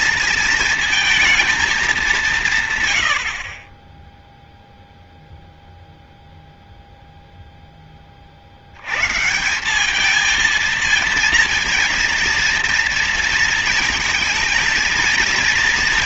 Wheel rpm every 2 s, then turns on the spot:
220, 120, 0, 0, 100, 230, 230, 230.
none